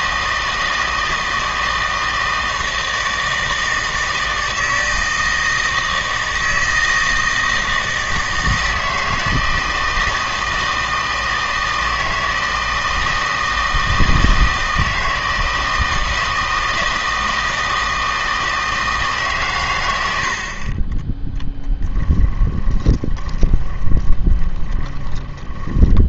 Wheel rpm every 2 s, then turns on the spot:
160, 160, 160, 160, 160, 160, 160, 160, 160, 160, 30, 20, 30.
22-26